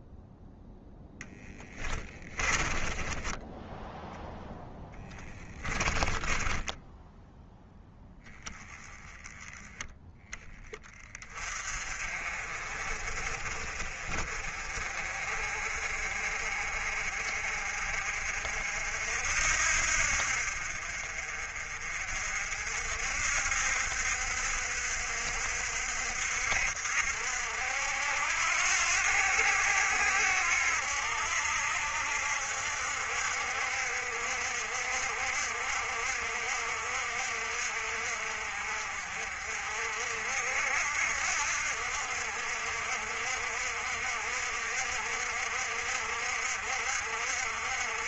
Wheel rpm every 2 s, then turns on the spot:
0, 20, 10, 10, 10, 20, 40, 50, 50, 60, 50, 60, 60, 70, 80, 70, 60, 60, 60, 50, 70, 60, 60, 60.
2-8